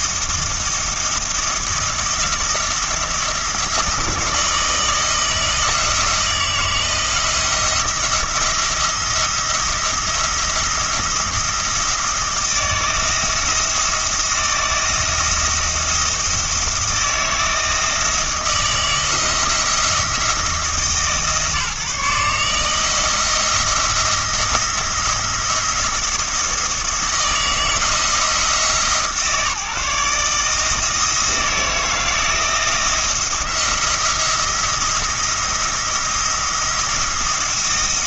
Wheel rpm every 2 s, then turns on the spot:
170, 160, 160, 160, 170, 170, 160, 160, 170, 170, 160, 160, 170, 170, 150, 160, 170, 170, 170.
none